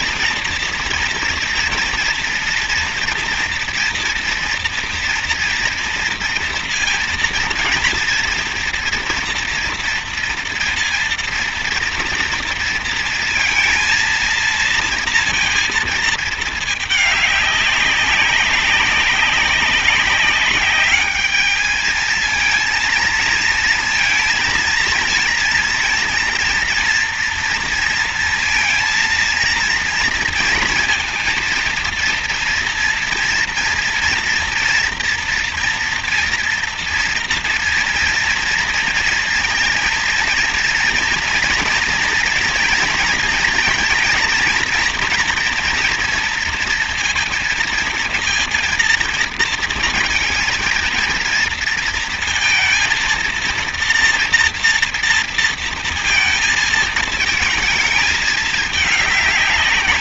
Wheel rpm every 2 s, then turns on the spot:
230, 230, 230, 230, 230, 230, 230, 230, 210, 200, 200, 230, 230, 230, 230, 230, 230, 230, 230, 230, 230, 230, 230, 230, 230, 230, 230, 230, 230, 210.
none